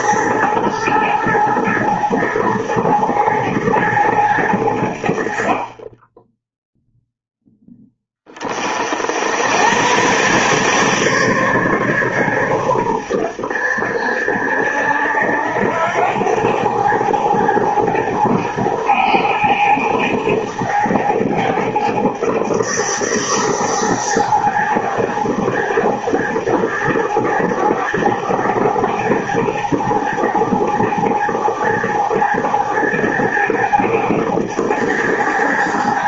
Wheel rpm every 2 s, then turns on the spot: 110, 110, 100, 0, 40, 140, 120, 70, 100, 100, 110, 100, 100, 110, 100, 110, 100, 100.
none